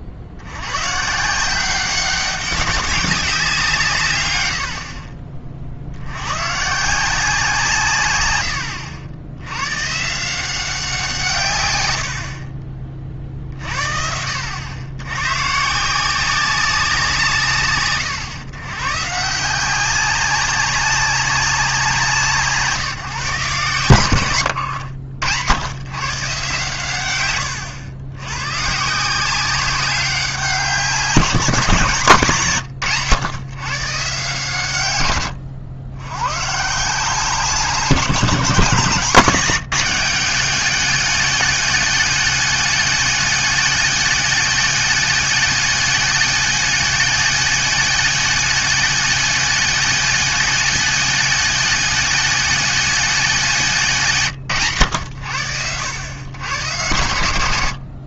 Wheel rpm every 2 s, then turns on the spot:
90, 190, 80, 140, 90, 180, 40, 80, 190, 130, 190, 150, 100, 130, 130, 180, 120, 120, 140, 170, 200, 210, 210, 220, 220, 210, 220, 130, 110.
24-26